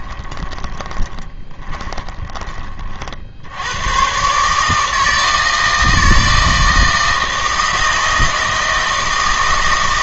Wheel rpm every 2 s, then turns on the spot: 20, 40, 150, 160, 160.
0-2